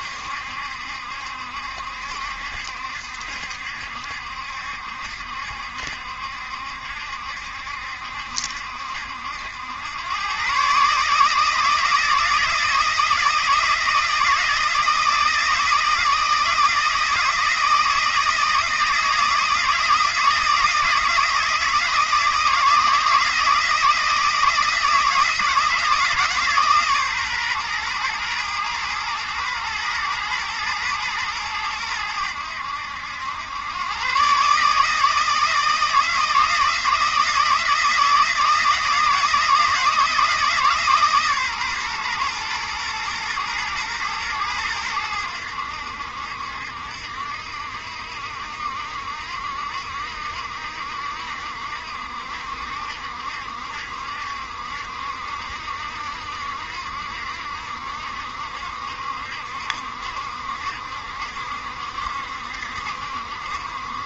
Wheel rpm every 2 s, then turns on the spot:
70, 70, 70, 70, 70, 150, 160, 160, 160, 160, 160, 160, 160, 140, 120, 110, 90, 160, 170, 160, 140, 120, 100, 70, 70, 60, 70, 70, 70, 70, 70, 70.
none